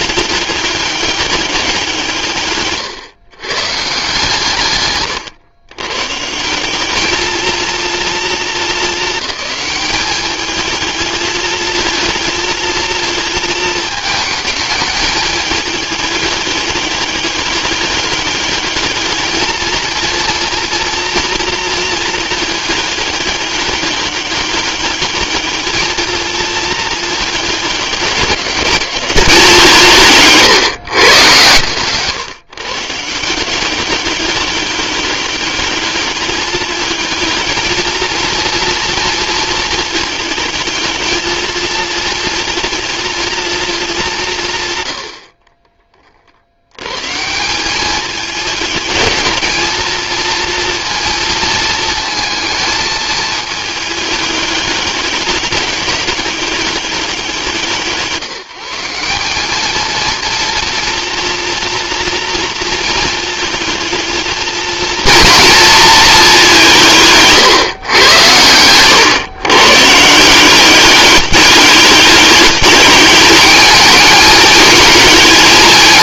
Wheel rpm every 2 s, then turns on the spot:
200, 130, 150, 190, 210, 220, 230, 210, 200, 210, 230, 210, 210, 220, 200, 130, 150, 200, 220, 230, 220, 230, 90, 130, 210, 230, 220, 200, 200, 180, 230, 230, 230, 160, 120, 200, 210, 220.
2-4